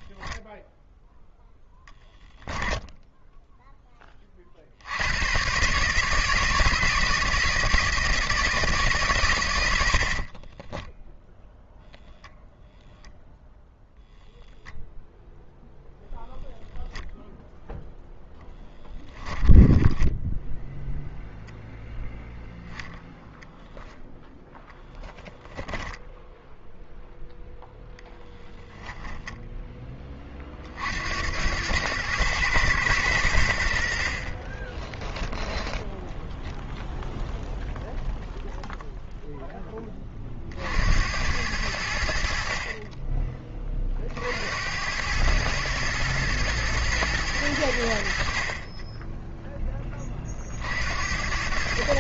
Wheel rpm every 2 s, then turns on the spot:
0, 10, 60, 160, 160, 20, 0, 0, 0, 10, 0, 0, 0, 0, 10, 50, 110, 20, 0, 0, 60, 40, 90, 120, 30, 60.
2-4 10-12 18-20 34-36